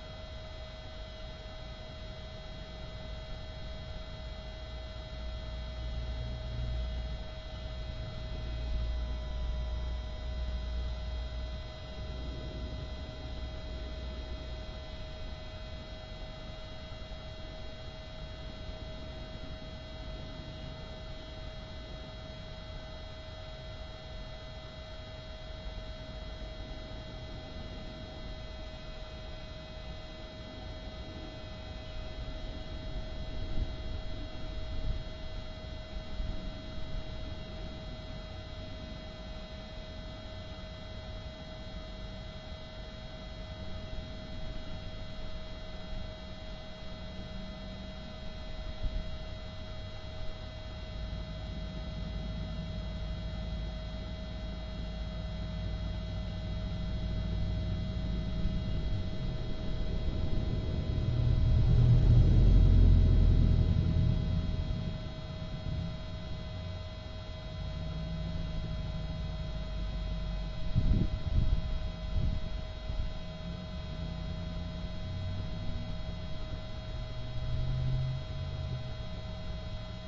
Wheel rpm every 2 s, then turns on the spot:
0, 0, 0, 0, 0, 0, 0, 0, 0, 0, 0, 0, 0, 0, 0, 0, 0, 0, 0, 0, 0, 0, 0, 0, 0, 0, 0, 0, 0, 0, 0, 0, 0, 0, 0, 0, 0, 0, 0, 0.
none